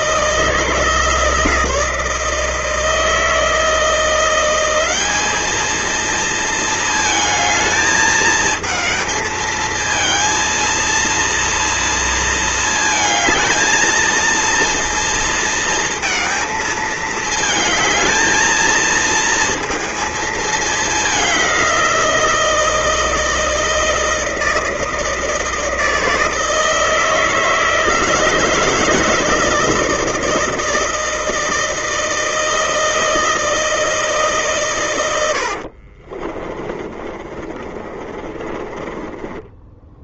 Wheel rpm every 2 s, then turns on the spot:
160, 160, 190, 230, 220, 230, 230, 230, 220, 220, 210, 170, 160, 160, 160, 160, 160, 130, 30, 20.
36-40